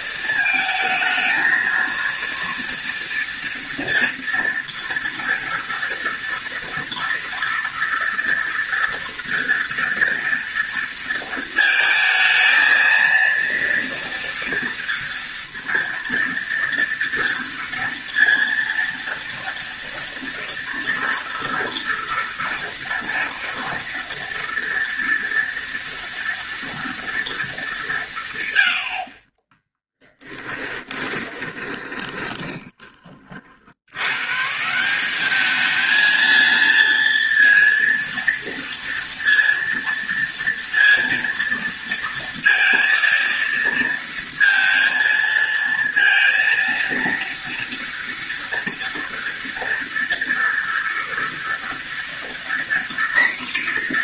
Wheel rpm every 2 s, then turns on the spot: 220, 230, 230, 230, 230, 230, 220, 230, 230, 230, 230, 230, 230, 230, 70, 10, 20, 170, 230, 230, 230, 230, 230, 230, 230, 230, 240.
30-32